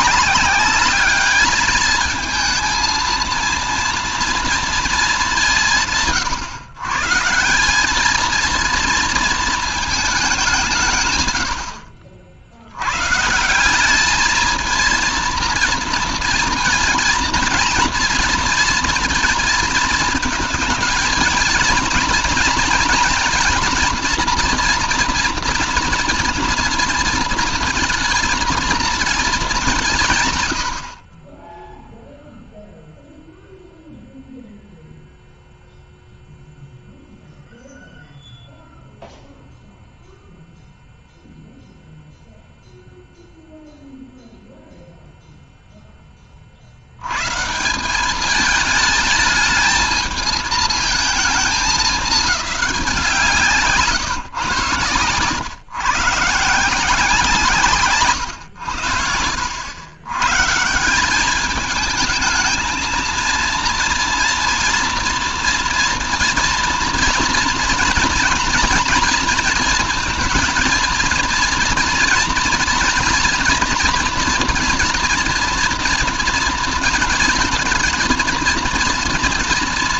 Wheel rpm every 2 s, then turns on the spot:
200, 230, 230, 120, 220, 180, 70, 220, 230, 230, 220, 230, 230, 230, 230, 100, 0, 0, 0, 0, 0, 0, 0, 40, 210, 220, 190, 120, 160, 110, 150, 220, 230, 230, 230, 230, 230, 240, 230, 230.
none